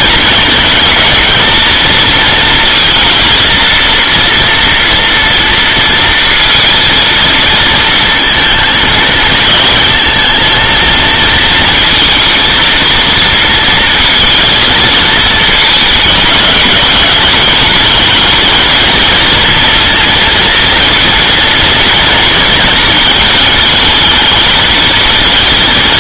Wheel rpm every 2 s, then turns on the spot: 220, 230, 230, 230, 220, 230, 230, 230, 210, 220, 230, 230, 220.
none